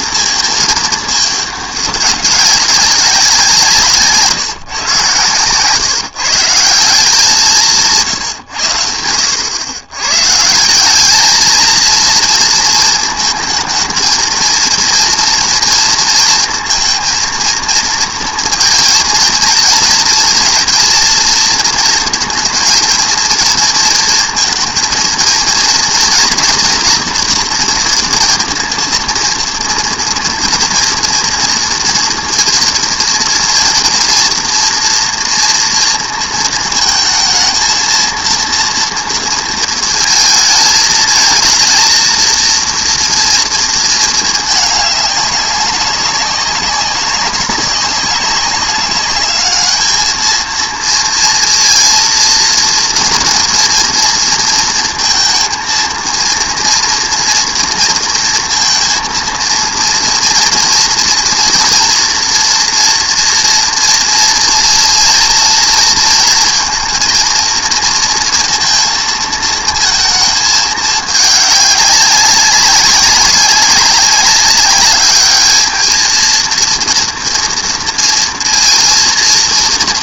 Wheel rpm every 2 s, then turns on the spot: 220, 190, 140, 170, 100, 170, 230, 230, 230, 230, 230, 230, 230, 230, 230, 230, 230, 230, 230, 230, 220, 230, 210, 200, 200, 230, 230, 230, 230, 230, 230, 230, 230, 230, 230, 220, 200, 200, 230, 230.
none